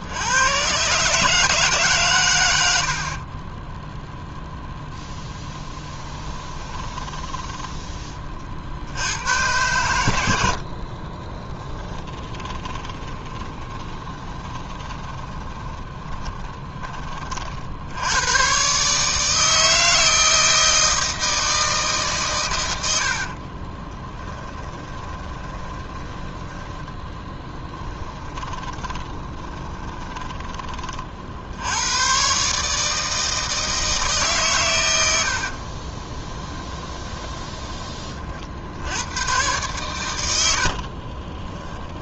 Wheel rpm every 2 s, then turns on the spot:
120, 90, 0, 20, 60, 60, 20, 20, 20, 120, 160, 100, 20, 10, 30, 30, 150, 110, 10, 80, 70.
6-8 10-18 24-30 36-38 40-42